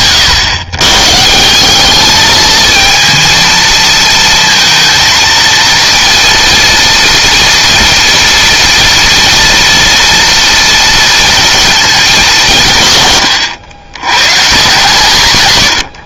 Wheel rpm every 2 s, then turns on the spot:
120, 230, 230, 230, 230, 230, 130, 160.
none